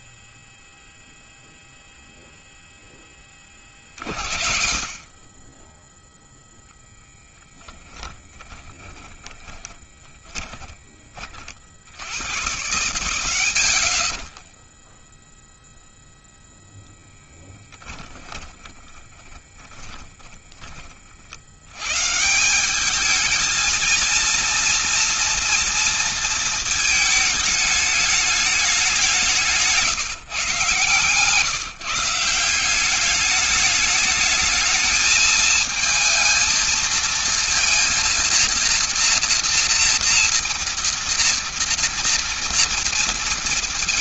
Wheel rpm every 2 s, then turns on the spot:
0, 0, 60, 10, 20, 20, 100, 10, 10, 20, 40, 200, 230, 220, 190, 140, 200, 220, 230, 240, 230, 230.
8-10 18-20